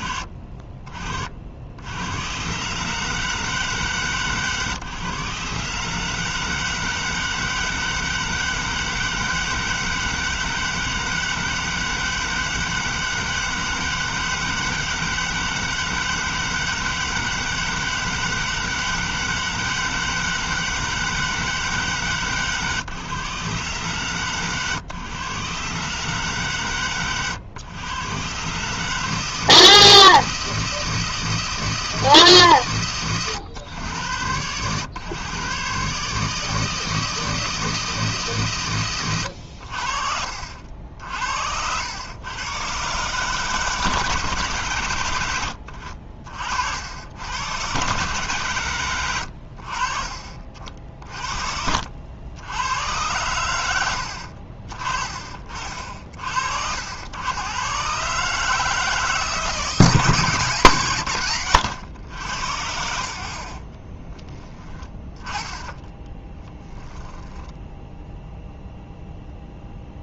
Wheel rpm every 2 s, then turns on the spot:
60, 150, 140, 160, 160, 160, 160, 160, 160, 160, 160, 130, 130, 100, 150, 160, 120, 120, 160, 110, 70, 130, 100, 80, 110, 50, 110, 40, 100, 160, 110, 70, 20, 10, 0.
66-68